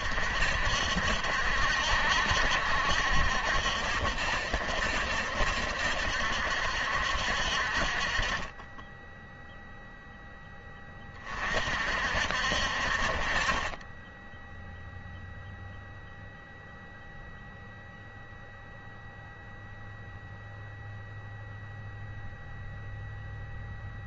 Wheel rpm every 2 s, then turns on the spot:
60, 60, 60, 70, 20, 10, 60, 0, 0, 0, 0, 0.
none